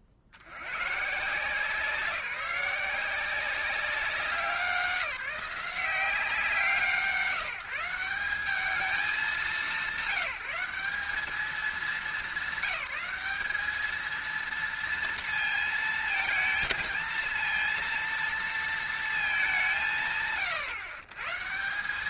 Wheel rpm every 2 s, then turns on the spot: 70, 180, 180, 170, 200, 200, 210, 230, 220, 230, 140.
none